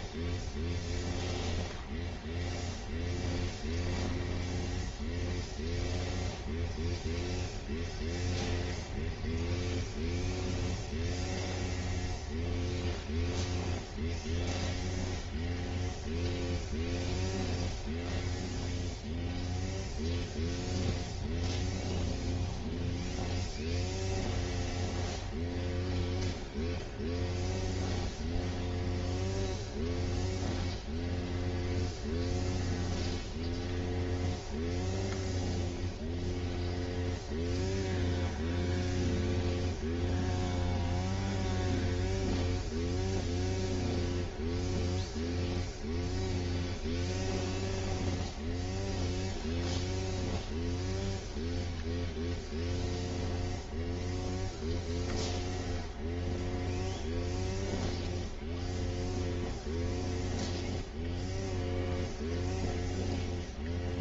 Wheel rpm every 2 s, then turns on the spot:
0, 0, 0, 0, 0, 0, 0, 0, 0, 0, 0, 0, 0, 0, 0, 0, 0, 0, 0, 0, 0, 0, 0, 0, 0, 0, 0, 0, 0, 0, 0, 0.
none